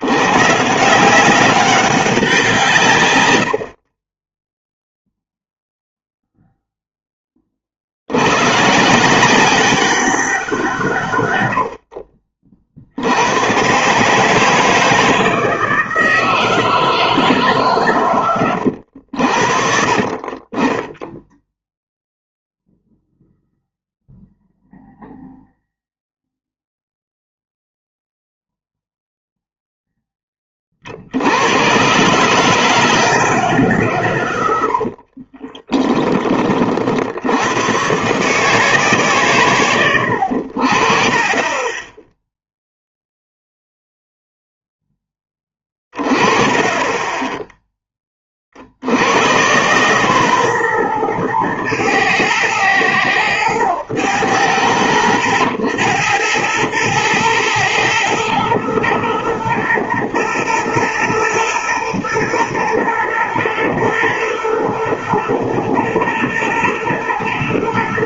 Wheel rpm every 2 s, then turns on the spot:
160, 150, 0, 0, 140, 170, 60, 160, 160, 90, 20, 0, 0, 0, 0, 40, 150, 70, 50, 140, 50, 0, 0, 20, 70, 120, 110, 90, 110, 120, 120, 120, 120, 110.
34-36 46-48